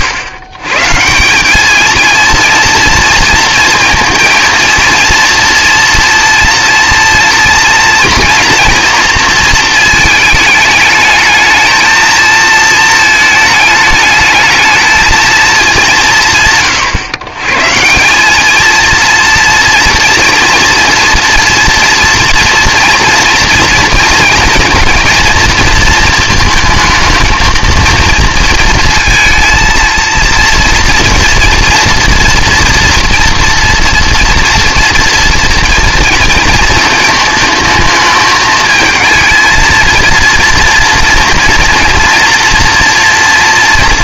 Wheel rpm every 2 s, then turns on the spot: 130, 230, 230, 230, 230, 220, 220, 210, 110, 220, 240, 230, 230, 220, 230, 240, 240, 230, 230, 220, 230, 240.
none